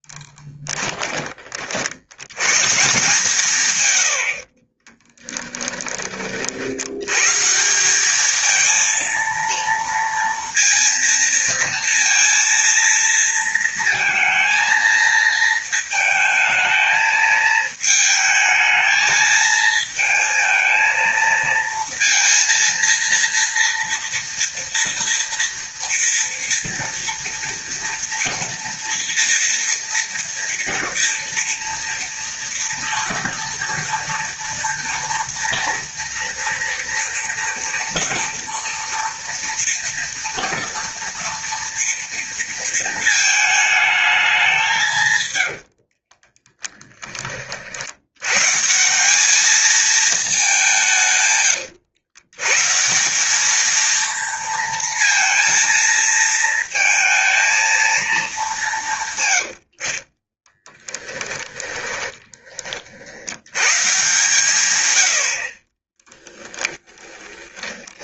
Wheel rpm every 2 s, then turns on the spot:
10, 140, 30, 70, 230, 230, 230, 220, 220, 220, 220, 230, 230, 230, 230, 230, 230, 230, 240, 230, 230, 230, 180, 20, 160, 170, 160, 230, 230, 190, 20, 50, 120, 10.
0-2 4-6 46-48 60-62 66-68